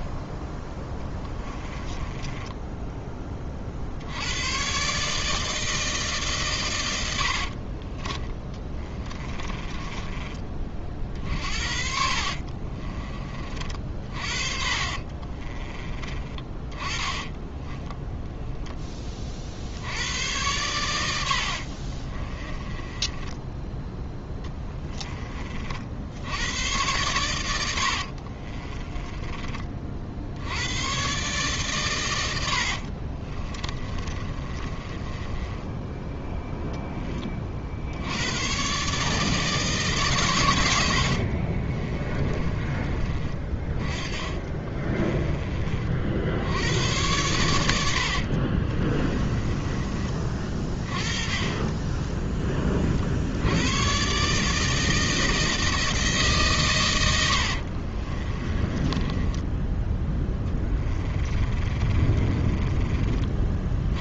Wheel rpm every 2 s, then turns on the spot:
10, 10, 120, 120, 20, 40, 30, 40, 20, 10, 100, 20, 10, 90, 30, 110, 60, 30, 10, 120, 100, 20, 20, 90, 40, 30, 20, 150, 130, 20, 20, 20.
0-4 8-10 12-16 22-26 28-30 32-36 44-46 48-52 58-64